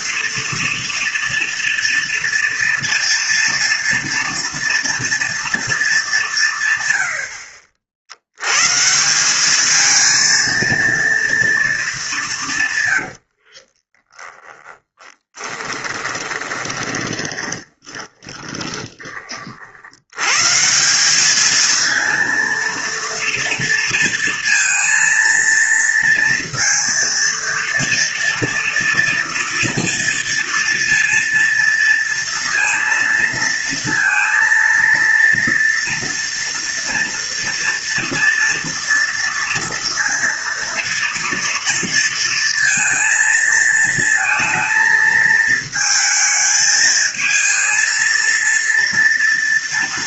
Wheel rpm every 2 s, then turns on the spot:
230, 230, 230, 150, 130, 230, 150, 10, 20, 20, 160, 230, 230, 230, 230, 230, 230, 230, 230, 240, 230, 230, 220, 220, 230.
14-20